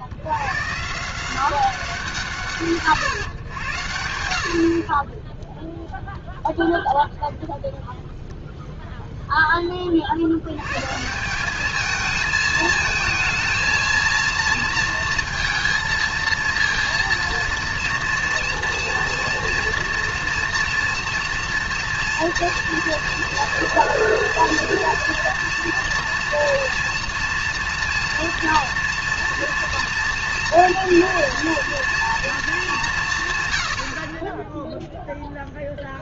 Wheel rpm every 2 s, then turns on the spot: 100, 130, 70, 0, 0, 80, 220, 230, 230, 230, 230, 230, 230, 230, 230, 240, 220, 20.
34-36